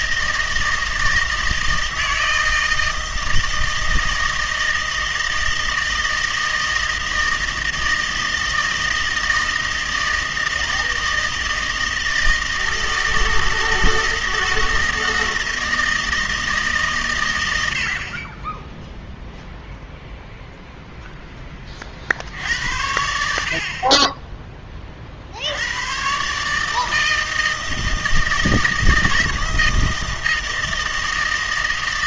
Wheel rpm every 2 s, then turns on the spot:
160, 160, 160, 160, 160, 160, 160, 170, 150, 10, 0, 80, 20, 150, 160, 160.
none